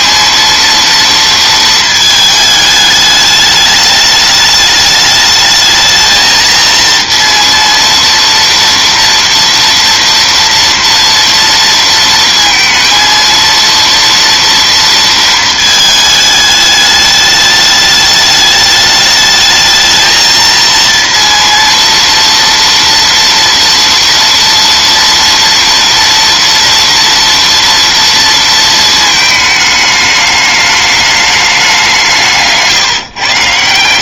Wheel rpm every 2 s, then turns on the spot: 230, 220, 210, 220, 230, 230, 230, 230, 220, 210, 230, 230, 230, 230, 230, 210, 160.
none